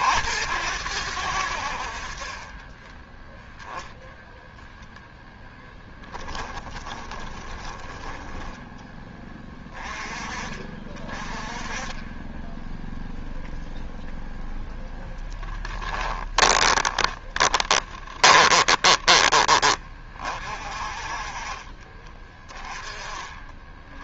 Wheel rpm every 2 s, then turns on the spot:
80, 30, 0, 10, 10, 30, 10, 0, 20, 20, 40, 20.
2-4 6-8 16-20